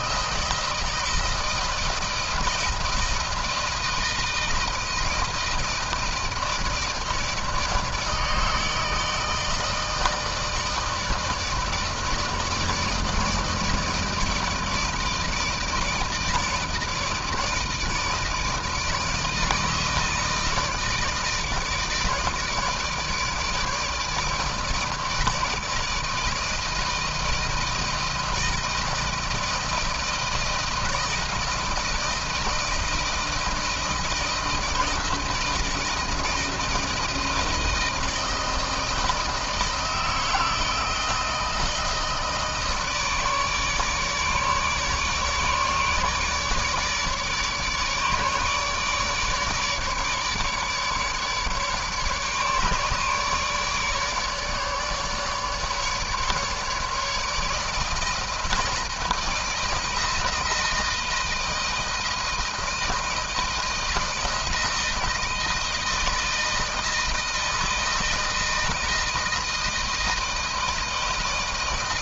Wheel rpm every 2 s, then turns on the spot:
160, 160, 160, 160, 160, 160, 160, 160, 160, 160, 160, 160, 160, 160, 160, 160, 160, 160, 160, 160, 160, 160, 150, 150, 150, 150, 150, 150, 150, 160, 160, 160, 160, 160, 160, 160.
none